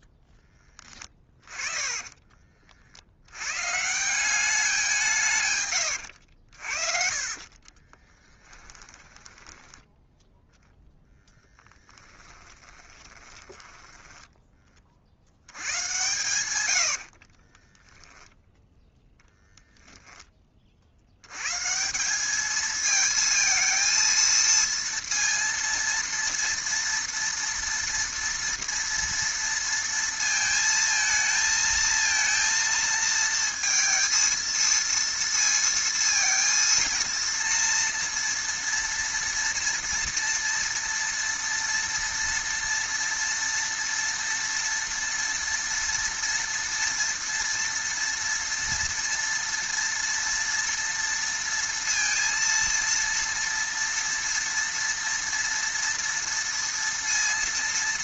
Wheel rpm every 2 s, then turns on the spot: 10, 40, 190, 60, 10, 0, 20, 20, 90, 0, 30, 220, 230, 230, 230, 230, 230, 230, 230, 230, 230, 230, 230, 230, 230, 230, 230, 230, 230.
0-2 6-10 12-14 16-18